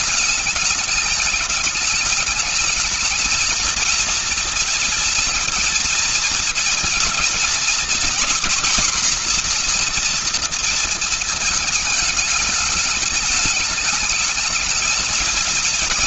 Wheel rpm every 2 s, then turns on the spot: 210, 220, 230, 230, 240, 230, 220, 220.
none